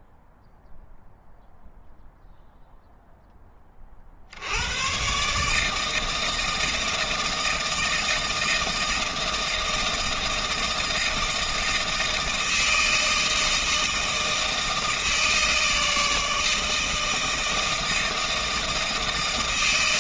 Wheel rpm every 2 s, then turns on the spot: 0, 0, 100, 160, 160, 160, 160, 160, 160, 160.
none